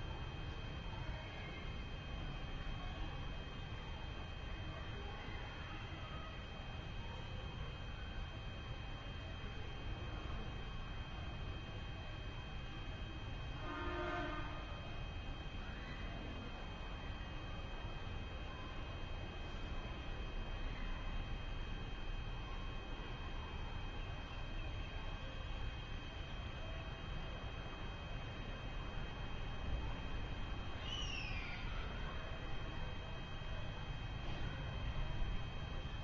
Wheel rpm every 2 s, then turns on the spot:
0, 0, 0, 0, 0, 0, 0, 0, 0, 0, 0, 0, 0, 0, 0, 0, 0, 0.
none